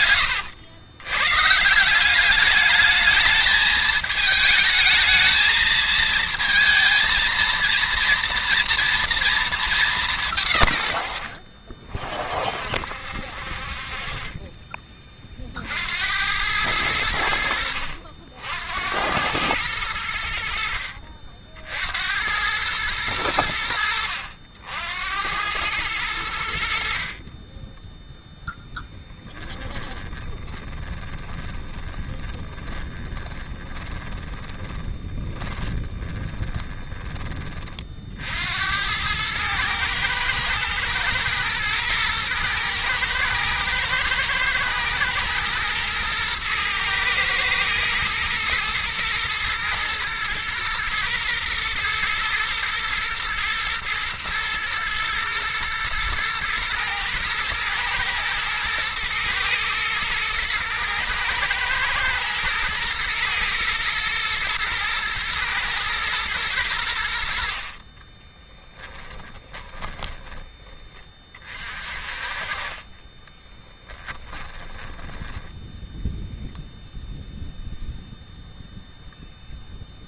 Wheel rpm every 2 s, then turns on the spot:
100, 210, 220, 230, 240, 120, 50, 30, 90, 80, 60, 100, 80, 60, 10, 30, 20, 20, 10, 90, 110, 110, 110, 120, 120, 110, 120, 110, 120, 110, 110, 120, 110, 100, 20, 20, 30, 20, 0, 0.
28-36 68-70 72-76